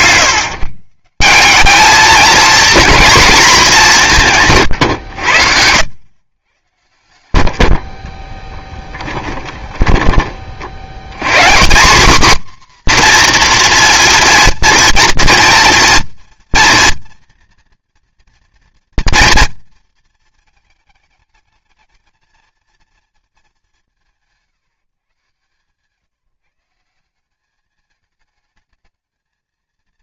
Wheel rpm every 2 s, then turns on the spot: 160, 230, 130, 100, 10, 60, 250, 230, 240, 230, 220, 220, 160, 170, 220.
4-6 8-10